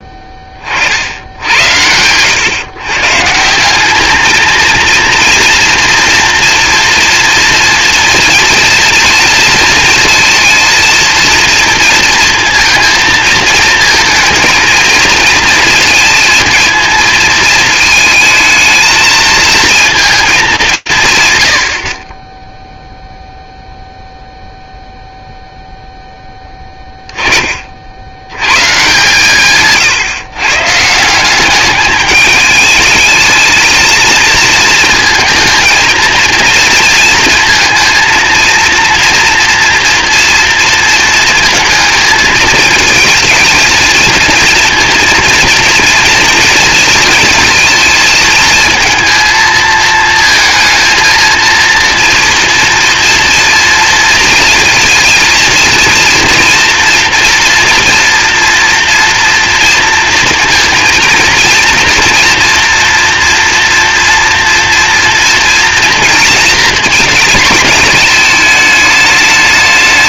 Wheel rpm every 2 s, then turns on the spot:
50, 130, 230, 230, 230, 230, 230, 220, 230, 220, 180, 0, 0, 20, 140, 150, 210, 230, 230, 230, 230, 220, 230, 230, 230, 220, 230, 230, 230, 230, 230, 230, 230, 230, 210.
none